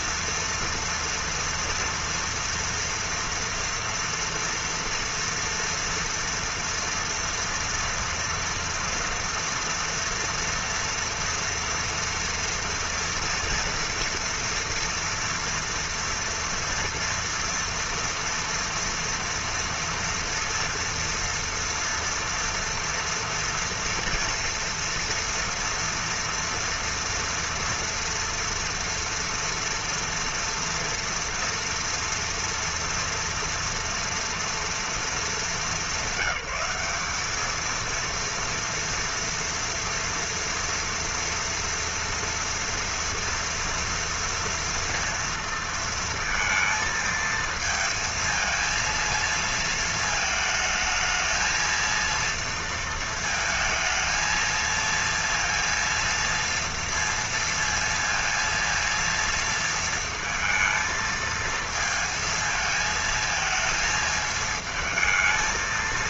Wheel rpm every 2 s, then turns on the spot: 230, 230, 230, 230, 230, 230, 230, 230, 230, 230, 230, 230, 230, 230, 230, 230, 230, 230, 190, 230, 230, 230, 230, 230, 230, 220, 230, 230, 230, 230, 230, 220, 220.
none